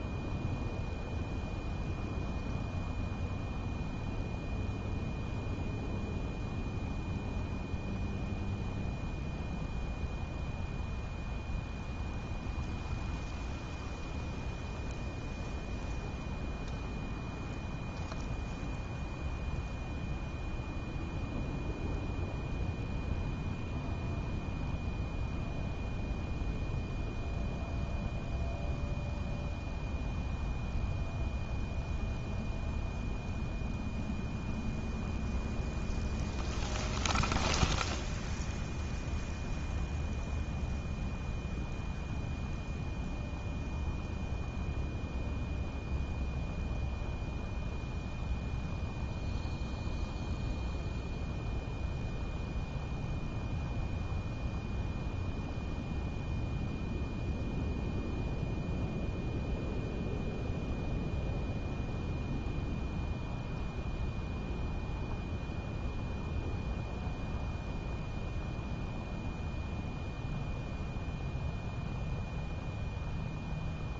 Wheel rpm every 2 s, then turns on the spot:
0, 0, 0, 0, 0, 0, 0, 0, 0, 0, 0, 0, 0, 0, 0, 0, 0, 0, 0, 0, 0, 0, 0, 0, 0, 0, 0, 0, 0, 0, 0, 0, 0, 0, 0, 0, 0.
none